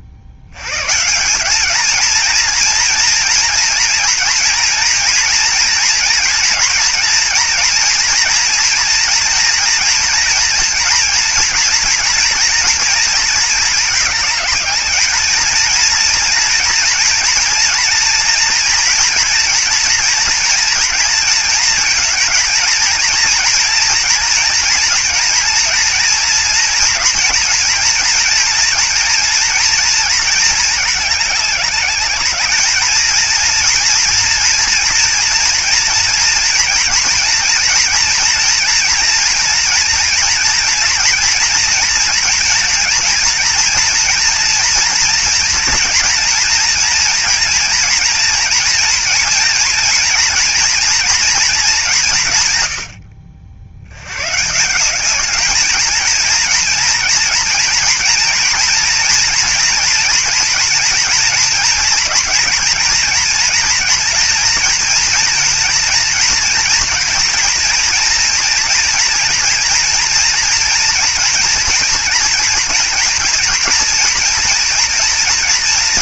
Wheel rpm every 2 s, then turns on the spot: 120, 230, 230, 230, 240, 240, 230, 210, 230, 240, 230, 230, 230, 230, 240, 220, 210, 230, 230, 230, 230, 230, 230, 230, 230, 230, 110, 160, 230, 230, 230, 230, 230, 230, 230, 230, 230, 230.
none